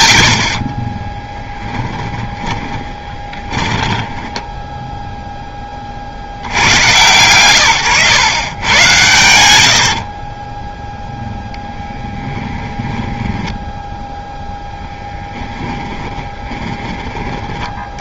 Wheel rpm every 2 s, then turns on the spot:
20, 20, 10, 130, 100, 0, 10, 10, 20.
0-6 12-16